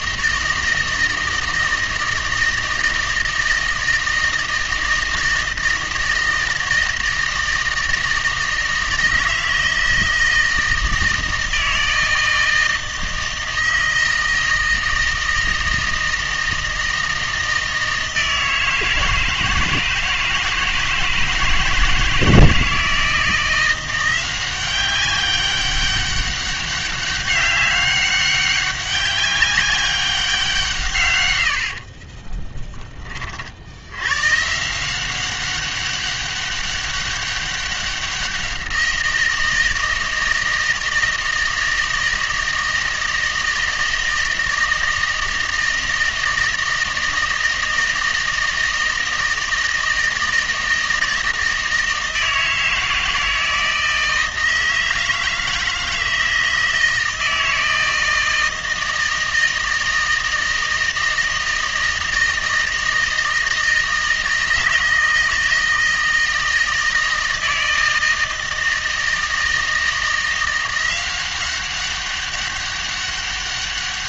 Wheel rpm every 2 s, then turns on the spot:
160, 160, 160, 160, 160, 160, 160, 160, 160, 160, 160, 160, 190, 200, 190, 160, 20, 160, 200, 180, 160, 160, 160, 160, 160, 160, 160, 160, 160, 160, 160, 160, 160, 160, 160, 180, 200.
none